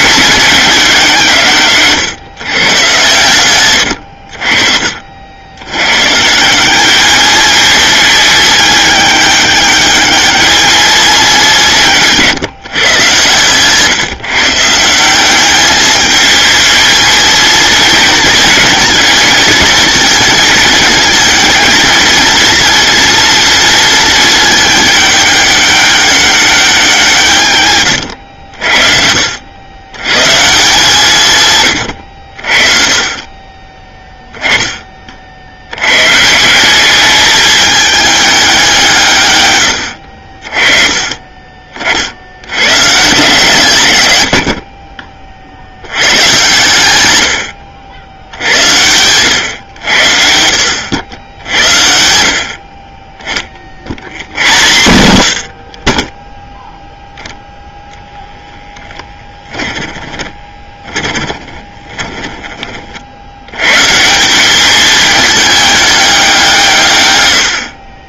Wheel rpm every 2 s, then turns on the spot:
190, 120, 40, 190, 210, 220, 140, 160, 220, 220, 220, 230, 210, 190, 60, 160, 40, 20, 190, 180, 30, 100, 40, 110, 80, 90, 40, 100, 0, 10, 20, 30, 210, 150.
60-62